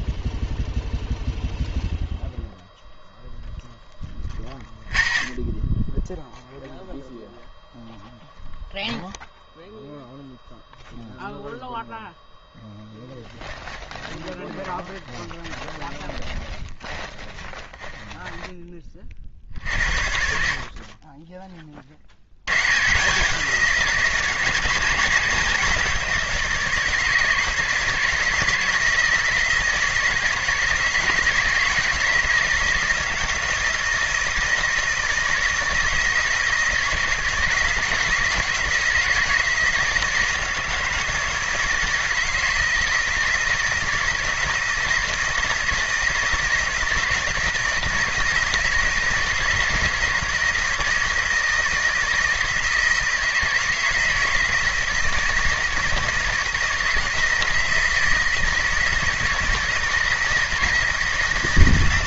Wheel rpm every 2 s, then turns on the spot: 0, 0, 40, 0, 0, 0, 0, 20, 20, 20, 50, 110, 170, 160, 160, 160, 160, 160, 160, 170, 160, 160, 160, 160, 160, 160, 160, 160, 170, 160, 160.
14-18